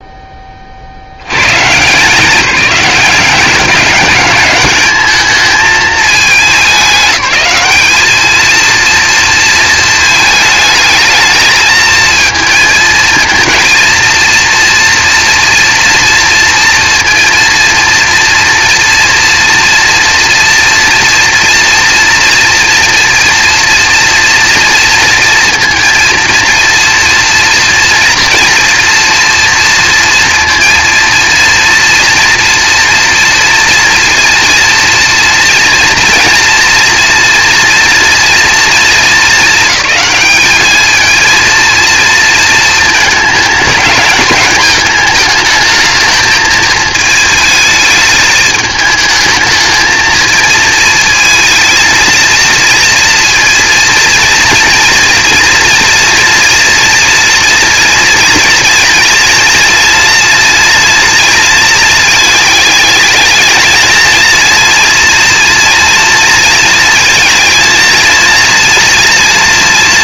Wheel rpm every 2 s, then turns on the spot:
20, 200, 210, 210, 230, 220, 220, 230, 230, 240, 240, 230, 230, 230, 230, 230, 230, 230, 240, 230, 210, 230, 220, 220, 220, 230, 230, 230, 240, 230, 230, 220, 230, 230, 230.
none